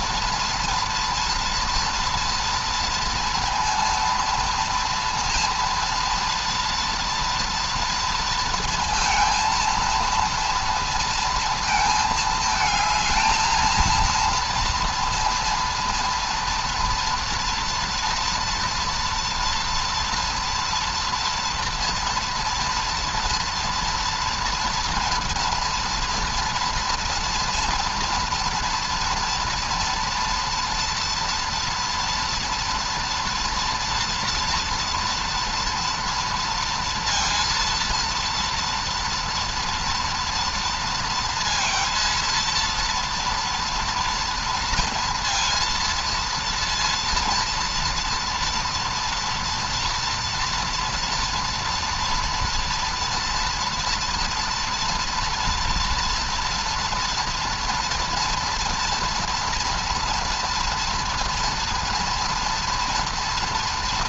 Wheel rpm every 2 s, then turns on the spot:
230, 230, 230, 230, 230, 230, 220, 230, 230, 230, 230, 230, 240, 240, 230, 230, 230, 230, 230, 230, 230, 230, 230, 230, 230, 230, 230, 230, 230, 230, 230, 230.
none